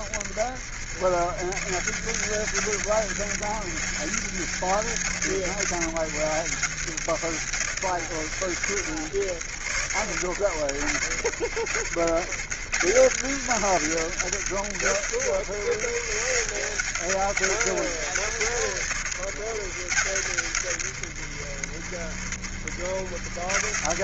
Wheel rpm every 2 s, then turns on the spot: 70, 90, 90, 80, 80, 70, 80, 80, 90, 90, 80, 70.
none